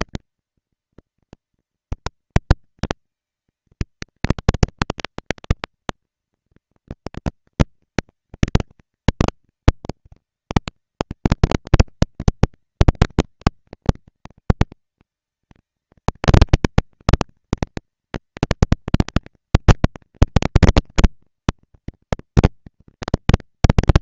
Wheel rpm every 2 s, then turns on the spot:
230, 230, 240, 230, 220, 190, 200, 210, 230, 230, 230, 230.
none